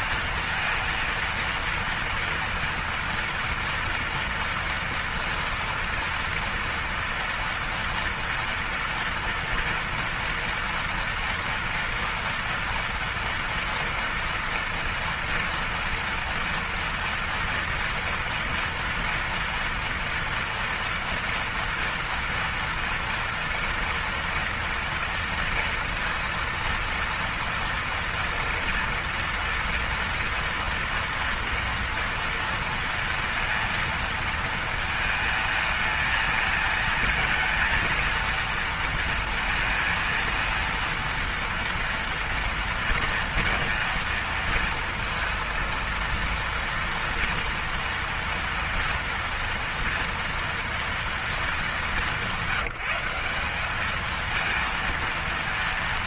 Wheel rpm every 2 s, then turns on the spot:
230, 230, 240, 230, 230, 230, 230, 230, 230, 230, 230, 240, 230, 230, 230, 230, 230, 230, 220, 230, 230, 230, 230, 230, 230, 230, 190, 220.
none